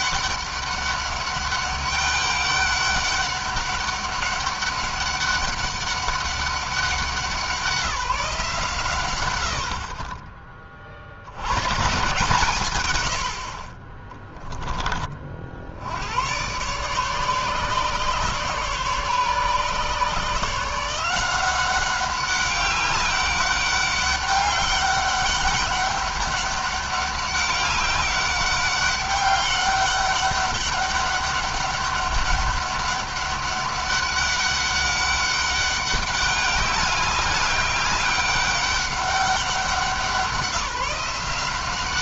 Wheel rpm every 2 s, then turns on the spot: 200, 200, 200, 190, 150, 50, 110, 20, 130, 140, 160, 190, 200, 200, 200, 200, 200, 200, 200, 200, 190.
none